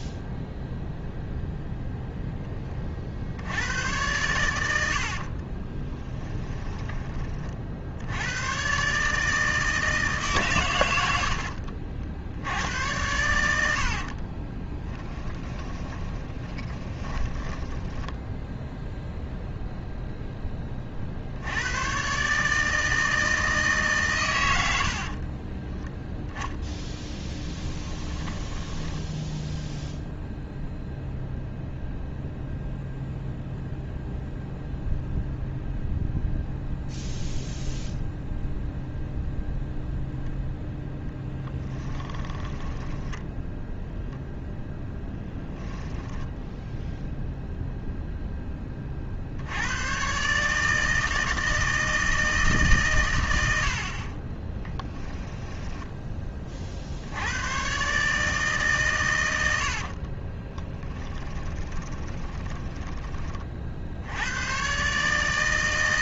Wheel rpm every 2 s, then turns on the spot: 0, 20, 80, 20, 140, 100, 90, 20, 30, 10, 30, 160, 90, 10, 10, 0, 0, 0, 0, 0, 0, 10, 10, 10, 30, 160, 140, 10, 50, 140, 20, 20, 140.
4-8 14-18 26-30 42-44 54-56 60-62